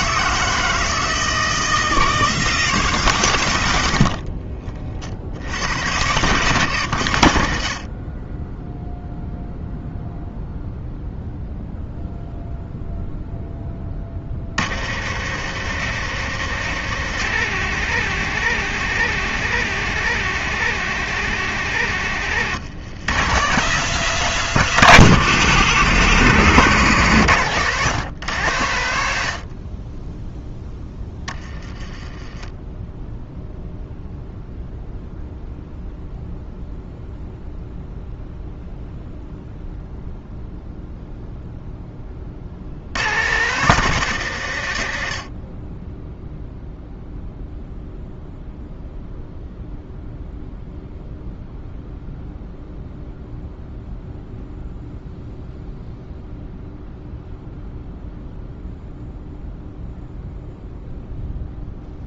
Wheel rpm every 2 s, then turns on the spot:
160, 160, 40, 100, 0, 0, 0, 80, 130, 130, 130, 110, 140, 120, 80, 10, 10, 0, 0, 0, 0, 70, 80, 0, 0, 0, 0, 0, 0, 0, 0.
30-32